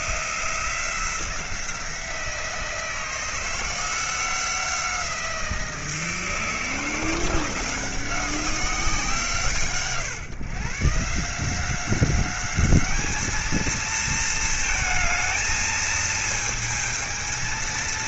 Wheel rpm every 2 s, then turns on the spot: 170, 170, 180, 170, 160, 140, 210, 220, 220.
none